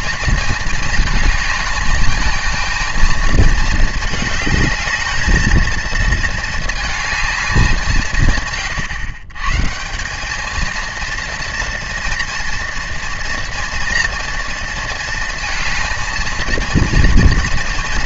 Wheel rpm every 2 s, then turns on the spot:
220, 230, 220, 220, 120, 230, 230, 230, 230.
none